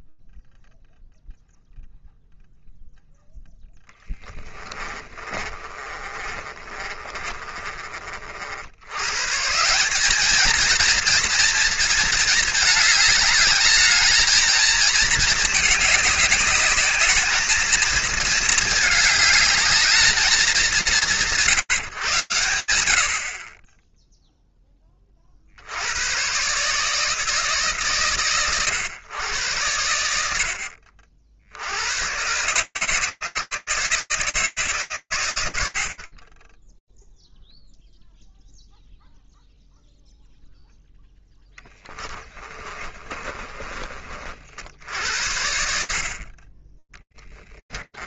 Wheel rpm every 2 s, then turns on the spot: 0, 0, 20, 30, 110, 230, 210, 220, 210, 220, 160, 70, 40, 150, 110, 60, 150, 120, 0, 0, 0, 30, 60, 10.
4-8 42-44